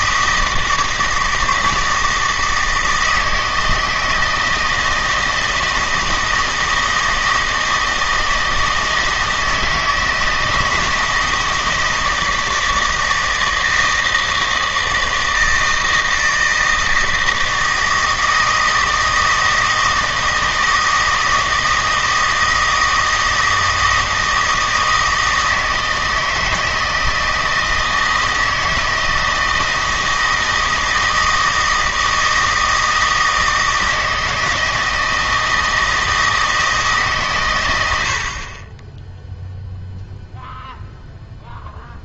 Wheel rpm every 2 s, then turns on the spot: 160, 160, 160, 160, 160, 160, 160, 160, 160, 160, 160, 160, 160, 160, 160, 160, 160, 160, 160, 20, 0.
none